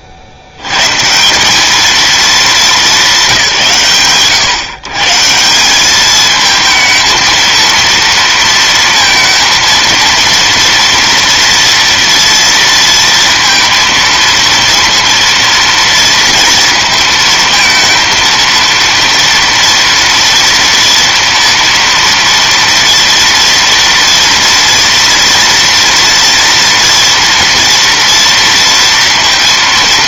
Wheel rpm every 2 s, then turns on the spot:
70, 210, 120, 220, 230, 230, 230, 230, 230, 230, 230, 230, 230, 230, 230.
none